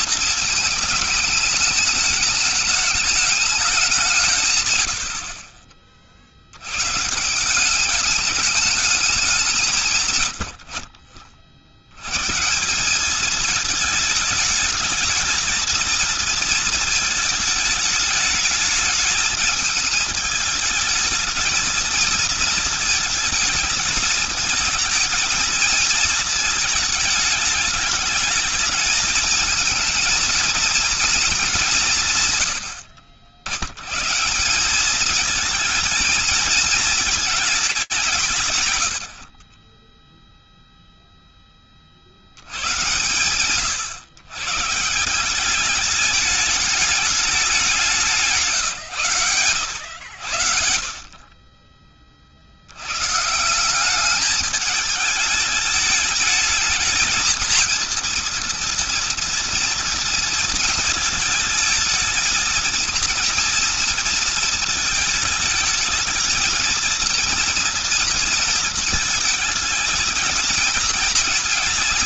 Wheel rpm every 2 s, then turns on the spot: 220, 210, 70, 130, 210, 60, 180, 220, 220, 220, 220, 220, 220, 220, 210, 230, 110, 190, 220, 130, 0, 100, 160, 210, 140, 50, 100, 210, 220, 230, 220, 230, 220, 220, 220, 230.
none